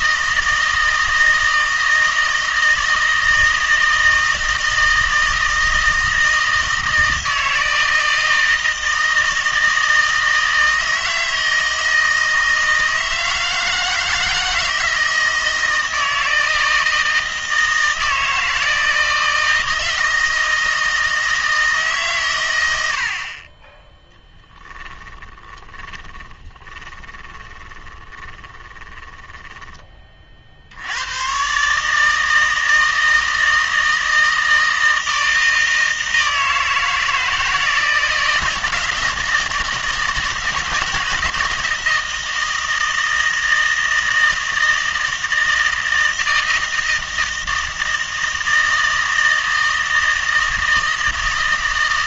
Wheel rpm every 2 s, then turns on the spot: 160, 160, 160, 160, 160, 160, 160, 160, 160, 160, 160, 90, 10, 20, 20, 80, 160, 160, 160, 160, 160, 170, 160, 160, 160, 160.
24-30